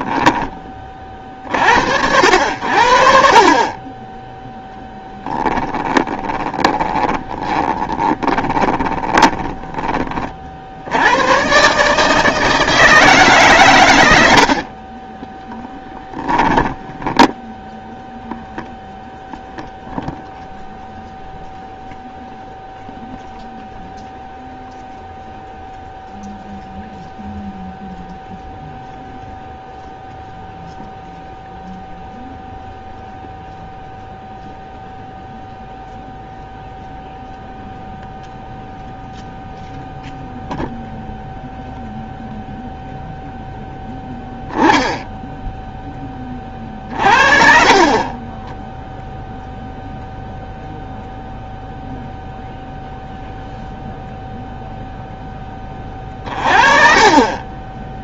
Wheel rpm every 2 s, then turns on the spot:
30, 60, 10, 20, 20, 70, 160, 40, 20, 0, 0, 0, 0, 0, 0, 0, 0, 0, 0, 0, 0, 0, 10, 40, 0, 0, 0, 0, 30.
6-10 16-18